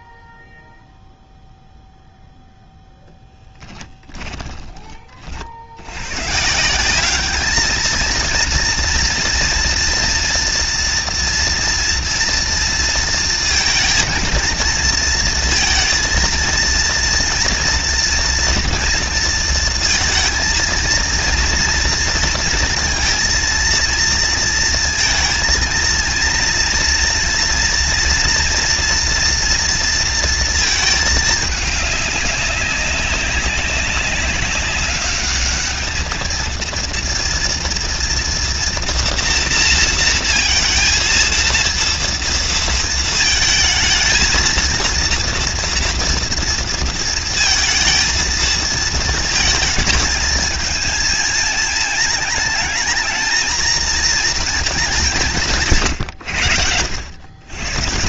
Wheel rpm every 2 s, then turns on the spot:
0, 10, 90, 220, 230, 230, 230, 230, 230, 230, 230, 230, 230, 230, 230, 200, 200, 220, 240, 230, 230, 220, 230, 230, 220, 220, 230, 130, 140.
2-4